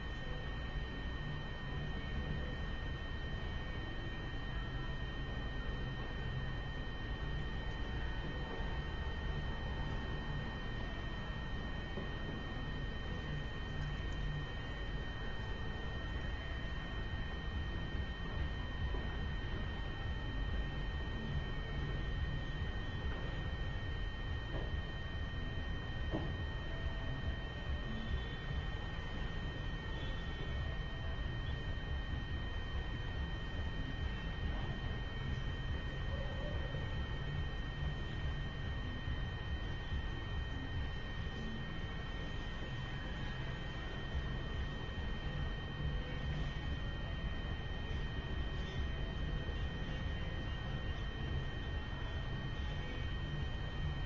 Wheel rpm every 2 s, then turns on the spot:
0, 0, 0, 0, 0, 0, 0, 0, 0, 0, 0, 0, 0, 0, 0, 0, 0, 0, 0, 0, 0, 0, 0, 0, 0, 0, 0.
none